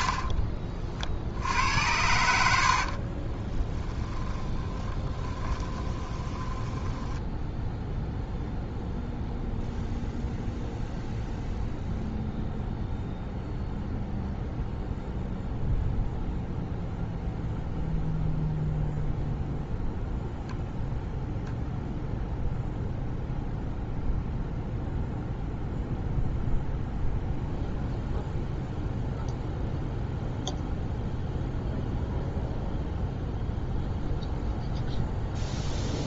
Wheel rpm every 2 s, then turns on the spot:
50, 50, 30, 20, 0, 0, 0, 0, 0, 0, 0, 0, 0, 0, 0, 0, 0, 0.
2-8